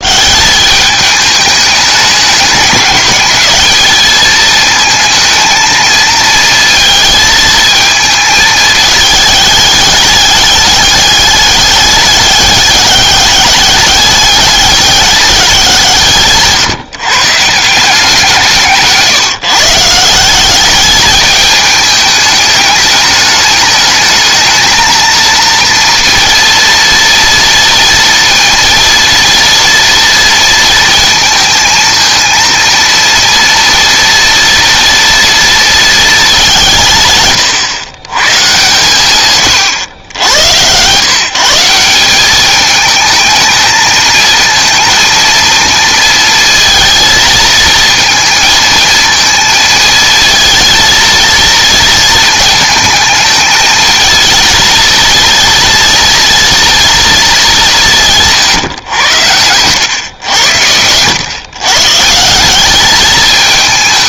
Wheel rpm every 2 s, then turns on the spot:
200, 210, 220, 220, 220, 200, 200, 200, 140, 160, 210, 210, 220, 230, 230, 230, 230, 230, 170, 120, 110, 210, 230, 230, 230, 230, 220, 230, 230, 120, 100, 190.
none